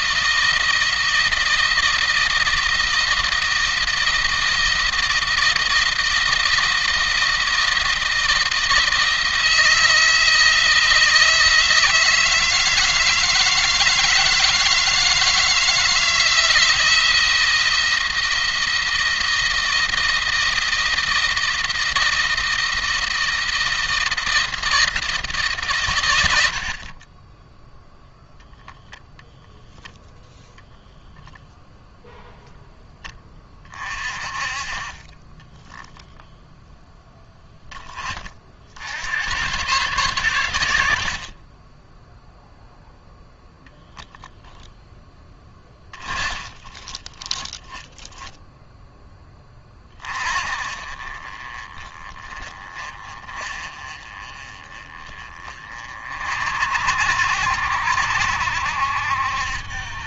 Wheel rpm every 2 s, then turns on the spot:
160, 160, 170, 160, 160, 160, 160, 160, 170, 170, 160, 160, 160, 70, 0, 0, 10, 30, 0, 70, 90, 0, 10, 30, 0, 40, 30, 30, 50, 70.
46-48